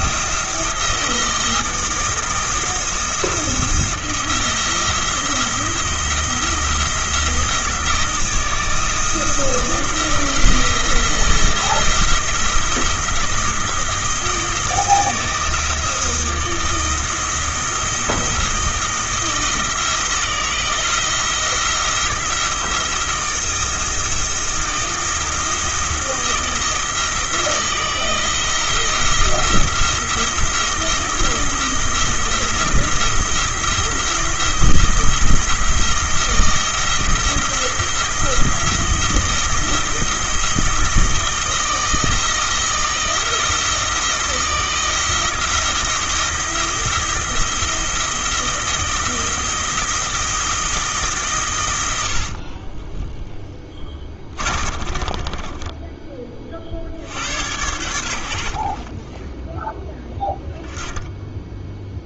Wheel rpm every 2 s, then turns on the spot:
170, 170, 170, 170, 160, 170, 170, 160, 160, 160, 160, 170, 170, 160, 170, 170, 170, 170, 170, 170, 170, 160, 160, 170, 160, 160, 20, 40, 60, 30, 10.
52-56